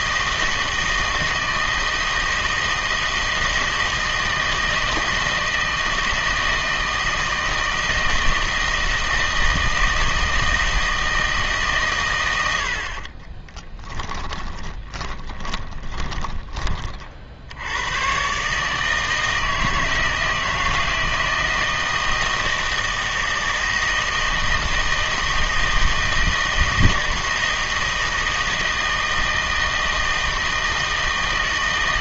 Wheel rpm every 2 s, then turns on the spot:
160, 160, 160, 160, 160, 160, 80, 20, 40, 150, 160, 160, 160, 160, 160, 160.
14-16